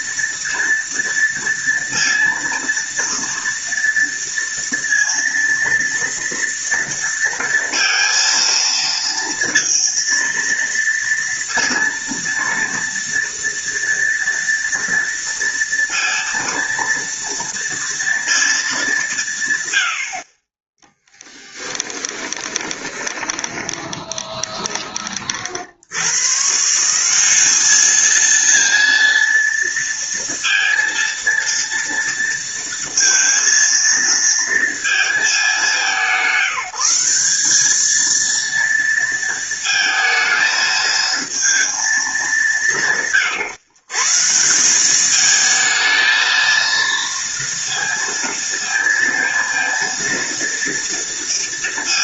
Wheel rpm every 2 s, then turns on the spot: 230, 230, 230, 230, 230, 230, 230, 230, 230, 190, 10, 20, 30, 170, 230, 230, 230, 220, 190, 230, 220, 160, 200, 230, 230, 230.
22-24